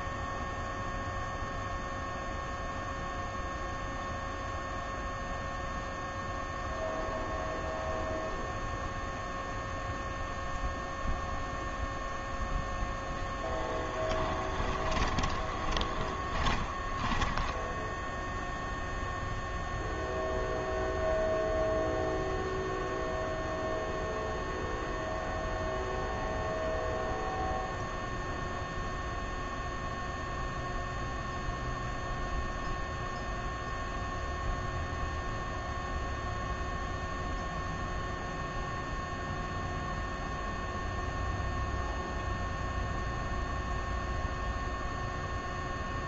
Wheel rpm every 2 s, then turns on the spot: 0, 0, 0, 0, 0, 0, 0, 20, 10, 0, 0, 0, 0, 0, 0, 0, 0, 0, 0, 0, 0, 0, 0.
14-18